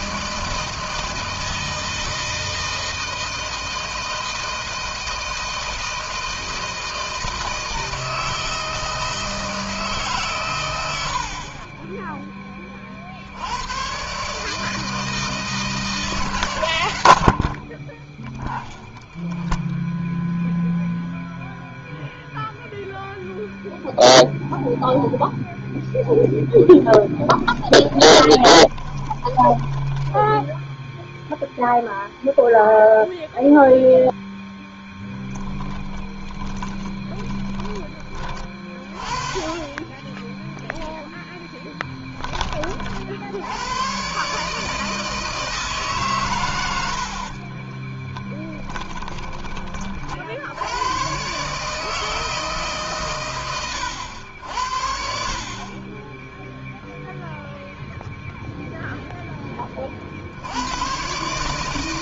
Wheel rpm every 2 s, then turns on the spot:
160, 160, 160, 160, 160, 100, 40, 160, 110, 0, 0, 0, 0, 10, 20, 0, 0, 0, 20, 30, 10, 40, 150, 80, 10, 110, 130, 60, 0, 0, 110.
26-30 36-38 46-48